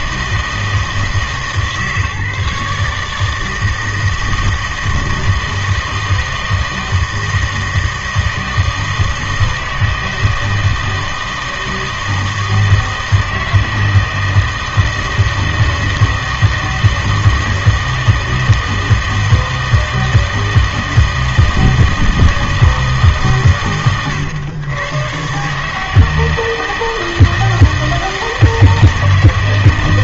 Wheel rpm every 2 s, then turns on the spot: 160, 150, 160, 160, 160, 160, 160, 160, 160, 160, 160, 160, 110, 160, 160.
none